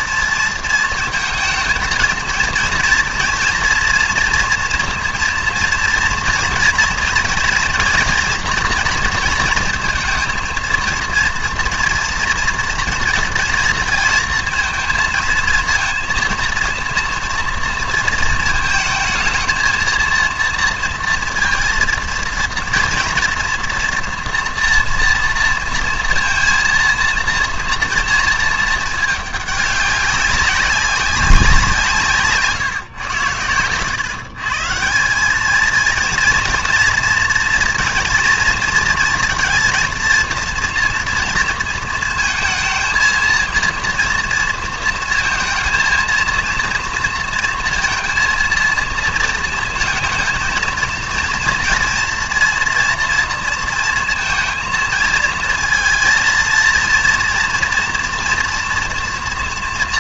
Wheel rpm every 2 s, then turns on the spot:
230, 230, 230, 230, 230, 230, 230, 230, 230, 230, 230, 230, 230, 230, 220, 200, 140, 150, 230, 230, 230, 230, 230, 230, 230, 230, 240, 230, 230, 230.
none